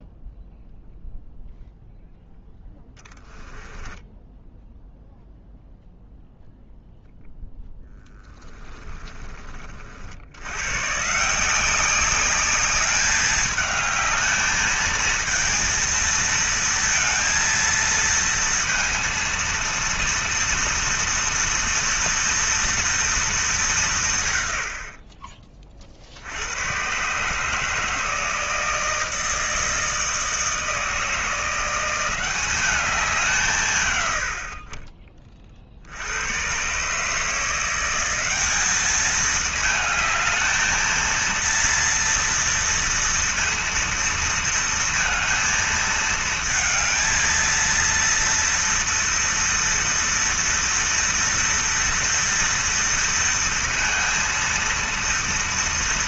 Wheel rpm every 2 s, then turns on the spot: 0, 10, 0, 0, 10, 130, 200, 220, 230, 230, 230, 230, 60, 120, 160, 160, 190, 40, 140, 210, 220, 230, 230, 220, 230, 230, 230, 230.
2-4